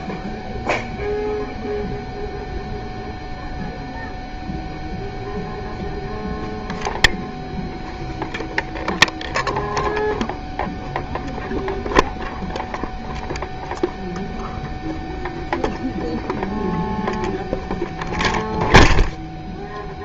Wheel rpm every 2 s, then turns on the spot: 0, 0, 0, 0, 0, 0, 0, 0, 0, 0.
none